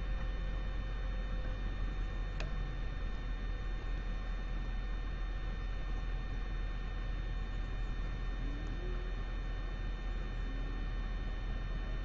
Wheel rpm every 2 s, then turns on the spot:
0, 0, 0, 0, 0, 0.
none